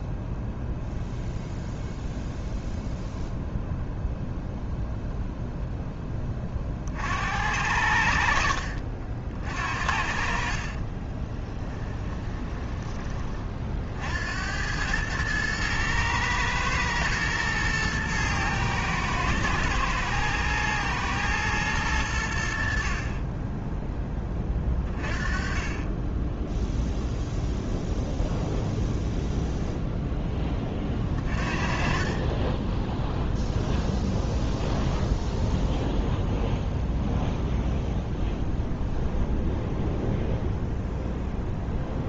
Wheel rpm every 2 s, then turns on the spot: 0, 0, 0, 40, 50, 40, 20, 90, 110, 110, 110, 60, 20, 10, 0, 20, 20, 0, 0, 0, 0.
8-14 32-34